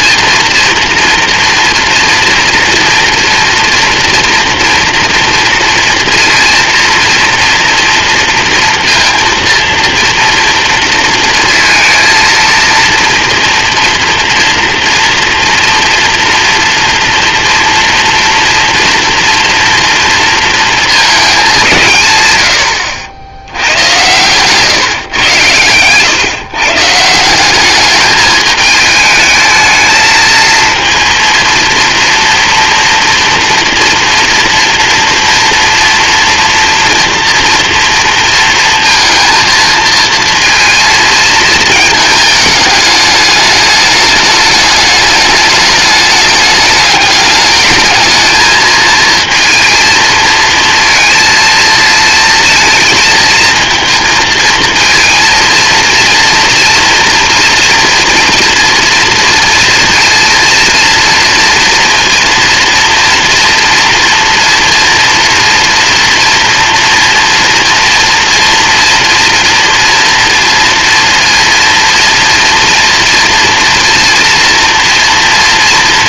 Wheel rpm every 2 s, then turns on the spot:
230, 240, 240, 230, 230, 230, 230, 240, 230, 230, 210, 100, 140, 170, 220, 230, 240, 230, 230, 230, 230, 210, 210, 210, 230, 230, 230, 230, 240, 230, 240, 230, 230, 230, 230, 230, 230, 230.
none